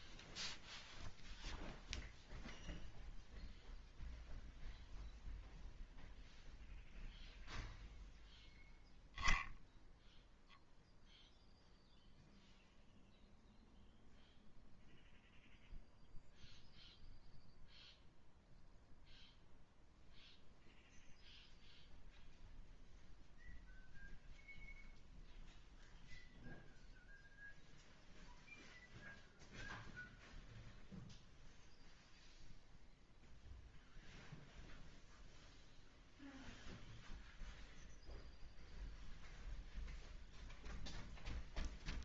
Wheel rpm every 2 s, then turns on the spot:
0, 0, 0, 0, 0, 0, 0, 0, 0, 0, 0, 0, 0, 0, 0, 0, 0, 0, 0, 0, 0.
none